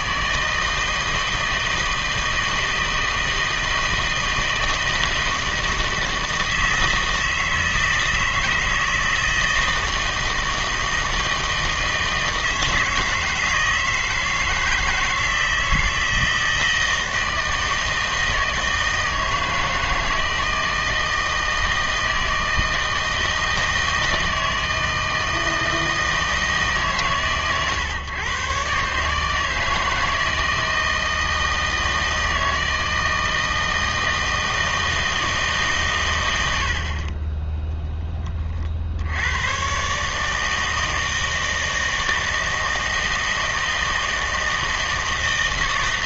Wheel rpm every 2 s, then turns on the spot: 160, 160, 160, 160, 160, 160, 160, 160, 160, 160, 160, 160, 160, 150, 140, 160, 160, 160, 80, 50, 160, 160, 160.
none